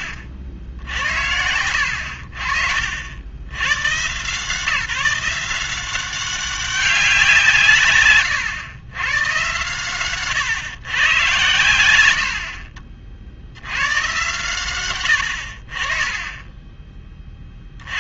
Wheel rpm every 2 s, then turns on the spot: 60, 60, 150, 190, 120, 120, 50, 140, 20.
0-2